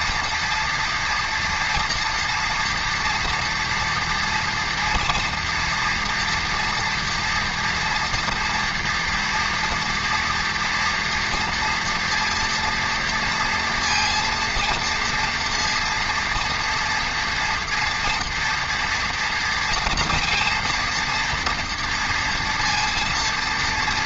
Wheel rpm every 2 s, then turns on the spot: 230, 230, 230, 230, 240, 230, 230, 230, 230, 230, 230, 230.
none